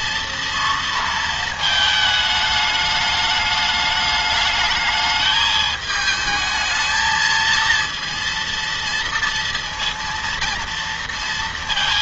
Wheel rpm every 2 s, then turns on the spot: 230, 210, 220, 220, 230, 230.
none